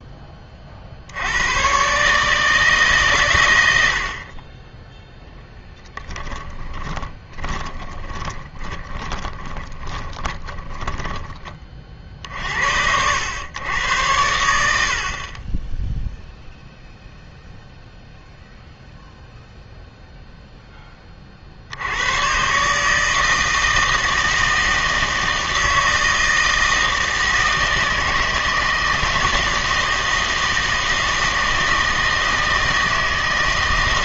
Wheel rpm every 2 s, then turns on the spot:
40, 150, 10, 20, 20, 20, 70, 70, 0, 0, 10, 140, 160, 160, 160, 160, 160.
6-12